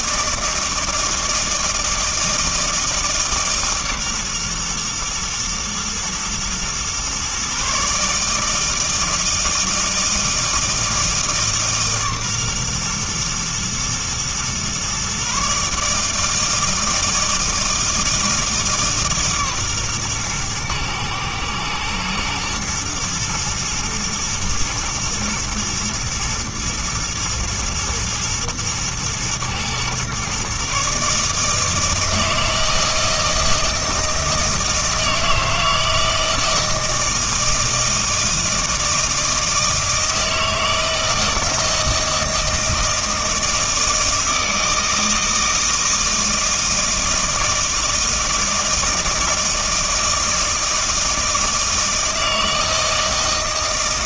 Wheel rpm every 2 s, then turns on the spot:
160, 160, 120, 120, 160, 160, 130, 120, 160, 160, 120, 120, 110, 120, 110, 140, 160, 160, 160, 160, 160, 160, 160, 160, 160, 160, 160.
none